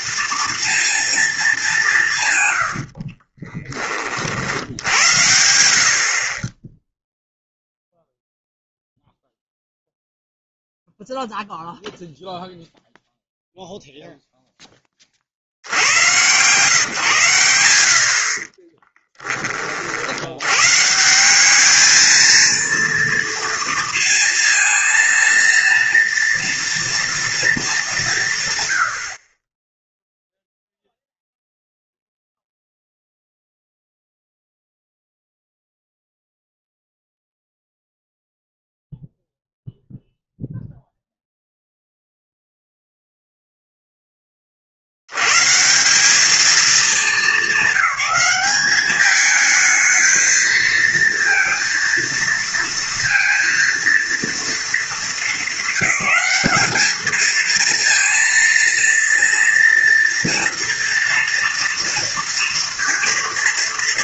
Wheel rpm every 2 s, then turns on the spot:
230, 90, 70, 20, 0, 0, 0, 10, 130, 30, 130, 230, 230, 230, 120, 0, 0, 0, 0, 0, 0, 0, 50, 220, 210, 220, 230, 230, 210, 230, 230, 230.
18-20